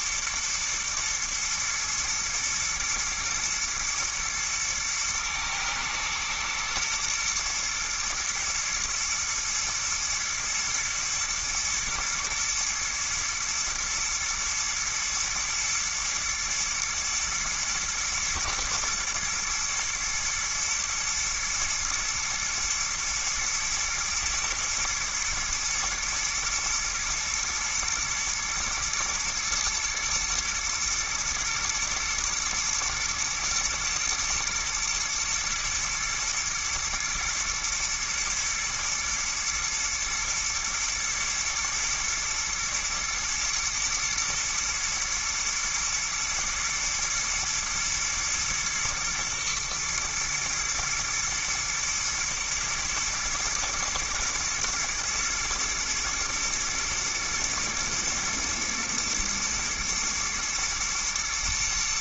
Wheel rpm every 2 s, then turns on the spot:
110, 120, 120, 110, 110, 110, 110, 110, 120, 110, 110, 110, 110, 120, 120, 120, 120, 110, 110, 120, 110, 110, 120, 120, 120, 110, 110, 120, 120, 120, 120.
none